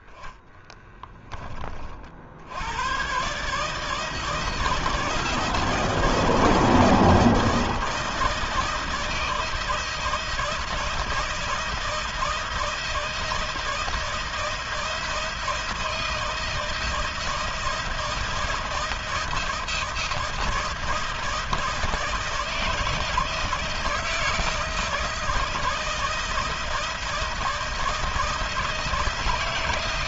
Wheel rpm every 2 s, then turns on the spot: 10, 110, 160, 160, 160, 160, 160, 160, 160, 160, 160, 160, 160, 160, 160.
none